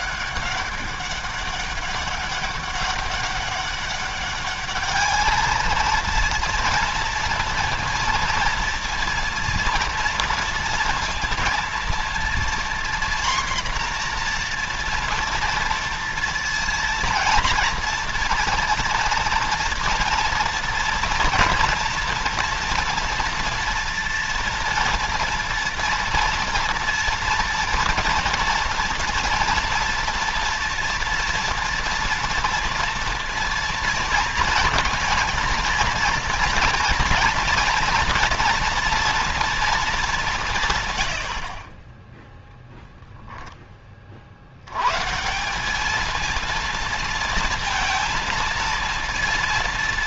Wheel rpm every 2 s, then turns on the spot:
200, 200, 200, 230, 230, 230, 240, 240, 230, 230, 230, 240, 240, 230, 230, 230, 230, 230, 240, 240, 170, 0, 50, 220, 230.
none